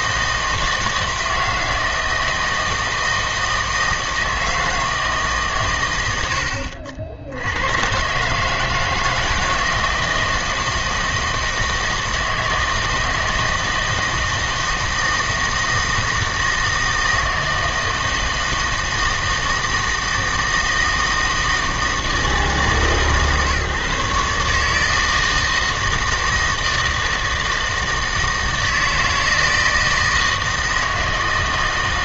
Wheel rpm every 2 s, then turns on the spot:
160, 160, 160, 70, 160, 160, 160, 160, 160, 160, 160, 150, 150, 160, 160, 160.
none